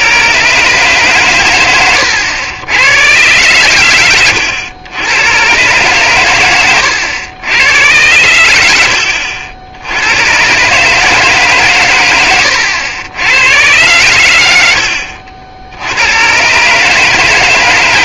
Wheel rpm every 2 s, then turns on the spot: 140, 110, 100, 100, 80, 140, 90, 80, 140.
none